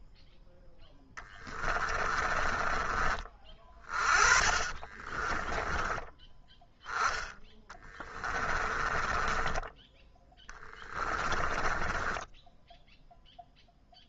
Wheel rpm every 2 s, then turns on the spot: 0, 20, 30, 10, 20, 20, 10.
2-6 8-12